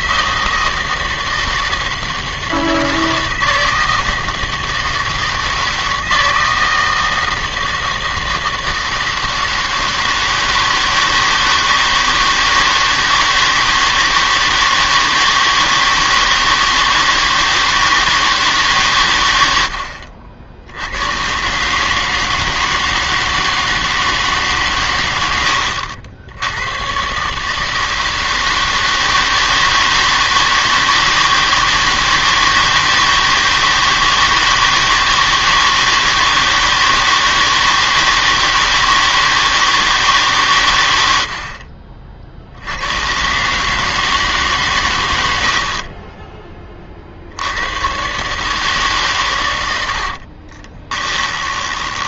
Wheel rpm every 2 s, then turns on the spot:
160, 160, 160, 160, 160, 160, 160, 160, 160, 140, 70, 160, 140, 110, 160, 160, 160, 160, 160, 160, 120, 70, 130, 20, 150, 30.
50-52